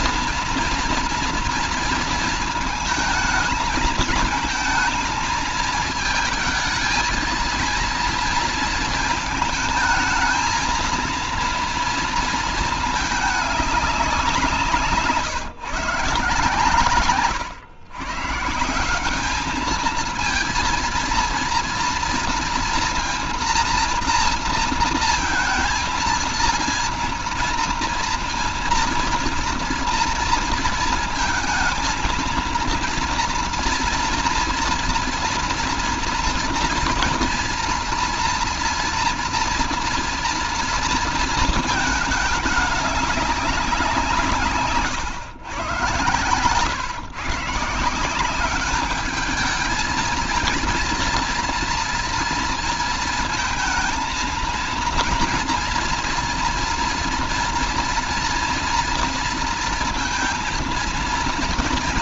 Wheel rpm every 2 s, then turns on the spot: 230, 220, 220, 230, 230, 230, 210, 160, 130, 190, 230, 230, 230, 230, 230, 230, 230, 230, 230, 240, 230, 200, 140, 140, 210, 230, 220, 230, 230, 230, 230.
none